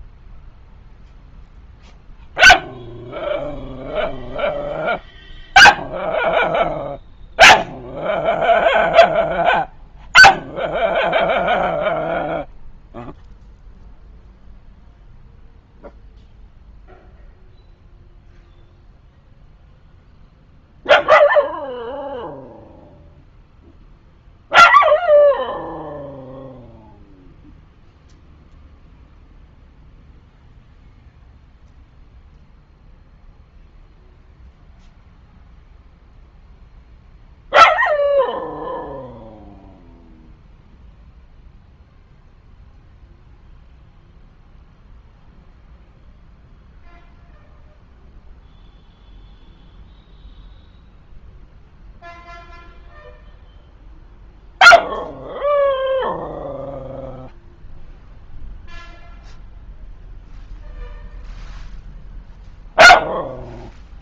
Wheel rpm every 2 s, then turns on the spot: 0, 0, 0, 0, 0, 0, 0, 0, 0, 0, 0, 0, 0, 0, 0, 0, 0, 0, 0, 0, 0, 0, 0, 0, 0, 0, 0, 0, 0, 0, 0, 0.
none